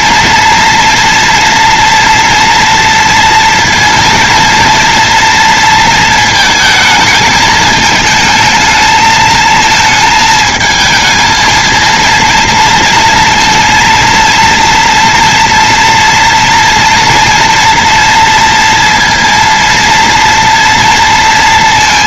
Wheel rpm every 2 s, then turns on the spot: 230, 230, 230, 230, 220, 220, 230, 230, 230, 230, 230.
none